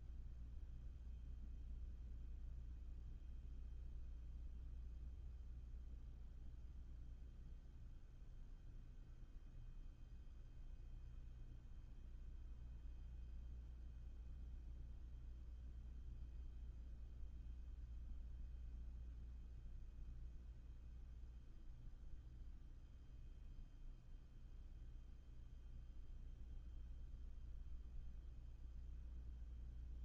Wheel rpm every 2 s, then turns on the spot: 0, 0, 0, 0, 0, 0, 0, 0, 0, 0, 0, 0, 0, 0, 0.
none